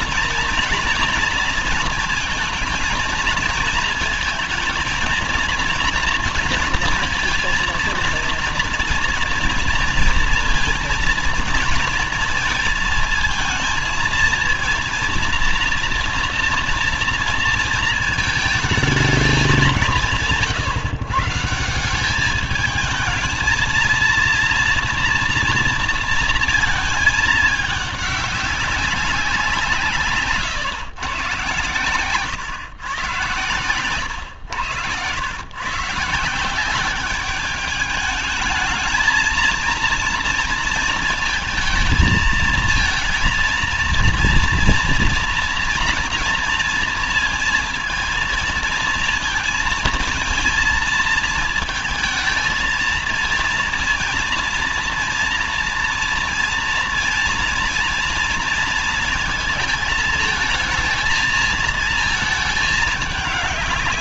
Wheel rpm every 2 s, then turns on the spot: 230, 220, 220, 230, 230, 230, 230, 230, 230, 220, 150, 210, 230, 230, 200, 150, 130, 110, 170, 210, 230, 220, 230, 230, 230, 230, 220, 240, 230, 230, 230, 220.
none